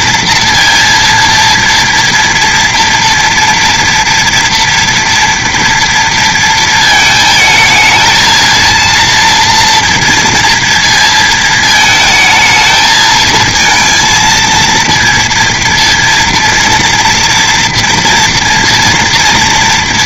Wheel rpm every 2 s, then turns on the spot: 230, 230, 230, 230, 220, 230, 220, 230, 230, 230.
none